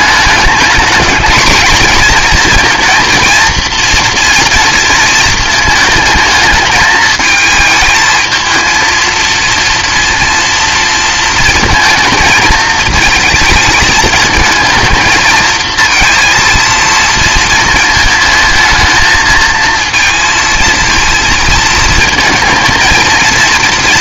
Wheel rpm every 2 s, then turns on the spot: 220, 230, 230, 220, 230, 230, 220, 220, 230, 220, 220, 230.
none